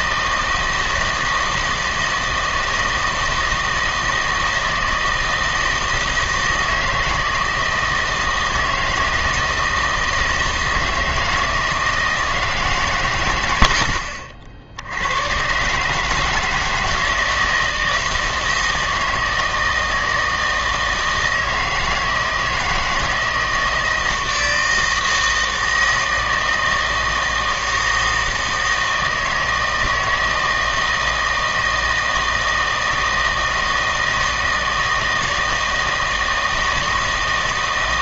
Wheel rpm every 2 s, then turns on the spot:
160, 160, 160, 160, 160, 160, 140, 70, 160, 160, 160, 160, 160, 160, 160, 160, 160, 160, 160.
none